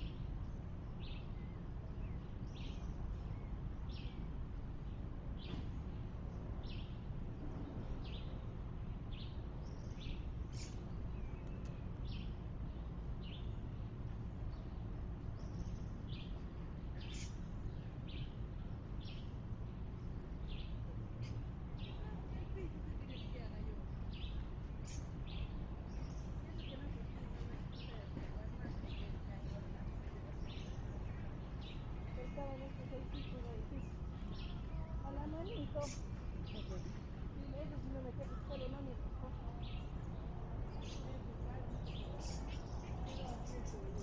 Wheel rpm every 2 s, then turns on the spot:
0, 0, 0, 0, 0, 0, 0, 0, 0, 0, 0, 0, 0, 0, 0, 0, 0, 0, 0, 0, 0, 0.
none